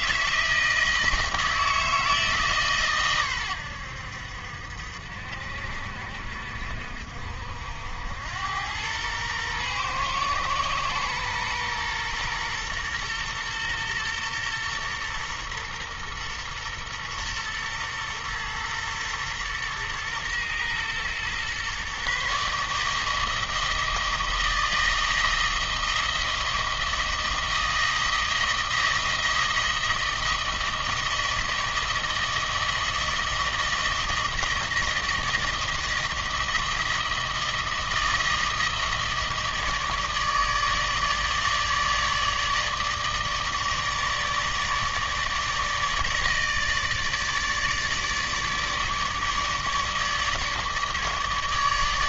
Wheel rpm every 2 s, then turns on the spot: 160, 140, 60, 60, 100, 120, 120, 120, 120, 120, 120, 150, 160, 160, 160, 160, 160, 160, 160, 160, 150, 150, 160, 150, 150, 150.
none